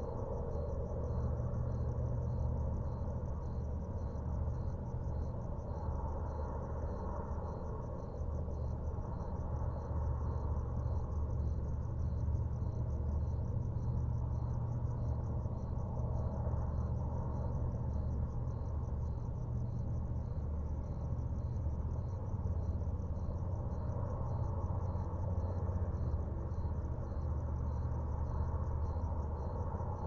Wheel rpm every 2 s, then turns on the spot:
0, 0, 0, 0, 0, 0, 0, 0, 0, 0, 0, 0, 0, 0, 0.
none